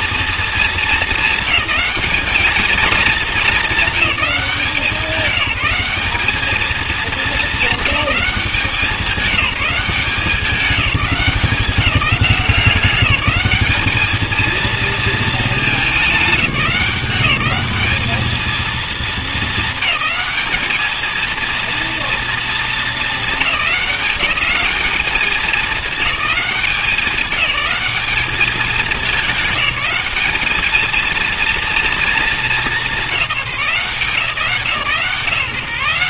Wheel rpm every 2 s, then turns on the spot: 220, 220, 190, 210, 190, 200, 180, 220, 180, 220, 210, 220, 200, 190, 210, 210, 210, 150.
none